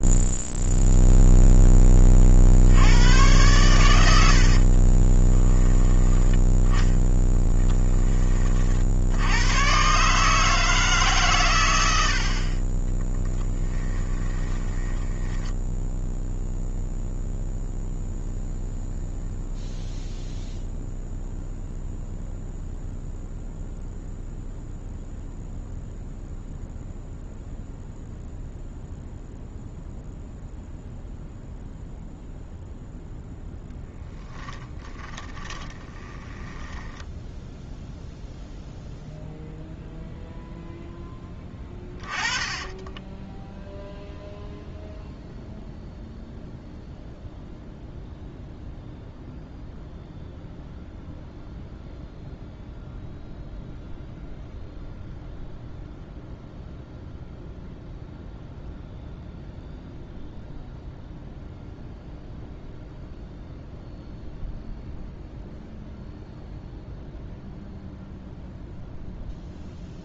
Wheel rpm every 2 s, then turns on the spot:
0, 80, 30, 0, 50, 150, 20, 10, 0, 0, 0, 0, 0, 0, 0, 0, 0, 20, 10, 0, 0, 10, 0, 0, 0, 0, 0, 0, 0, 0, 0, 0, 0, 0, 0.
4-6 12-16 34-38 42-44